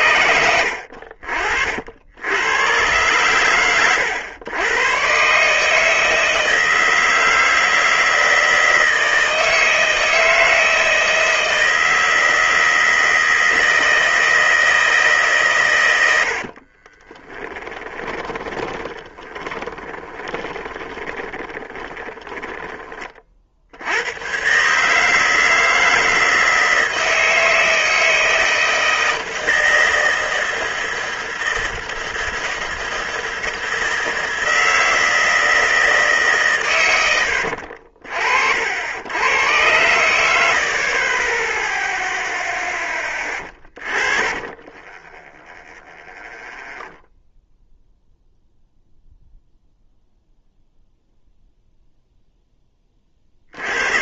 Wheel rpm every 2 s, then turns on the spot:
70, 100, 100, 160, 160, 160, 160, 160, 40, 10, 30, 20, 130, 160, 160, 160, 160, 160, 130, 70, 60, 10, 20, 0, 0, 0, 10.
16-24 44-46